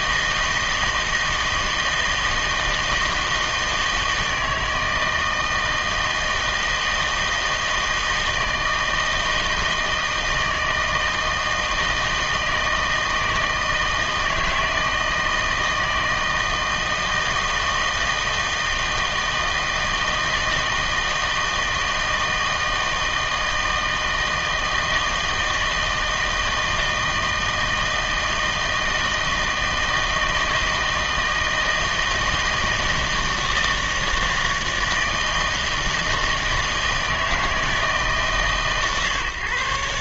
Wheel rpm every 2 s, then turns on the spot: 160, 160, 160, 160, 160, 160, 160, 160, 160, 160, 160, 160, 160, 160, 160, 160, 160, 160, 160, 140.
none